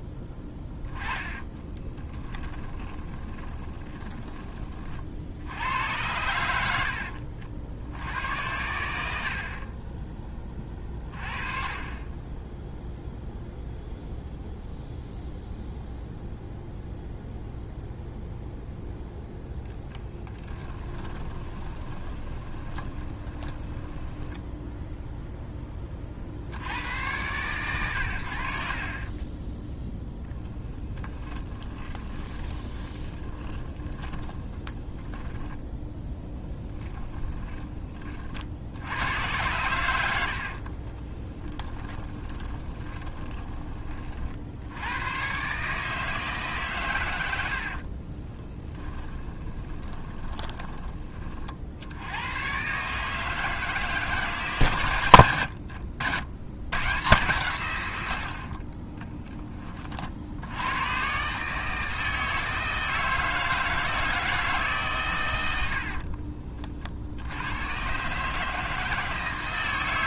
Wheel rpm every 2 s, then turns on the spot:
10, 20, 30, 80, 80, 30, 10, 0, 0, 0, 20, 20, 0, 90, 50, 10, 20, 10, 10, 70, 40, 20, 100, 140, 10, 20, 140, 130, 110, 40, 100, 160, 140, 50, 150.
0-4 20-24 30-38 40-44 48-50